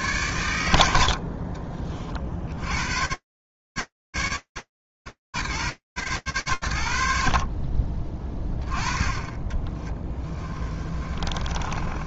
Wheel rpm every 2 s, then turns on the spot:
60, 120, 40, 20, 20, 30.
6-10